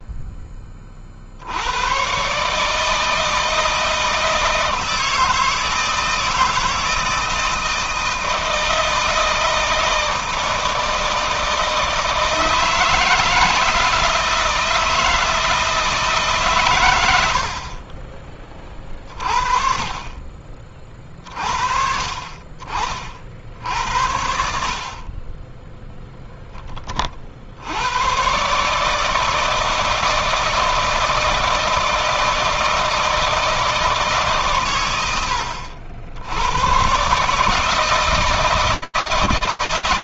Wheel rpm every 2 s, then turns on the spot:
40, 160, 160, 160, 160, 160, 160, 160, 100, 30, 40, 50, 60, 40, 150, 160, 160, 110, 120, 160.
none